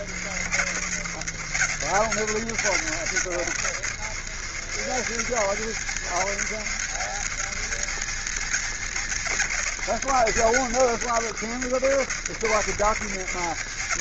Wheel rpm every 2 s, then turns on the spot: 80, 90, 90, 100, 100, 90, 80.
none